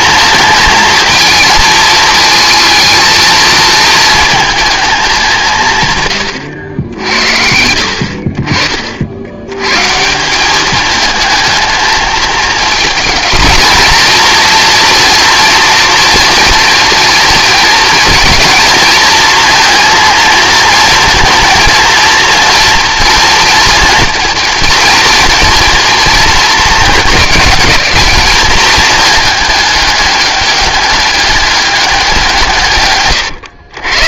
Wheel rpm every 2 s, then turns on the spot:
230, 220, 220, 80, 40, 200, 220, 230, 230, 230, 230, 230, 220, 220, 210, 200, 160.
none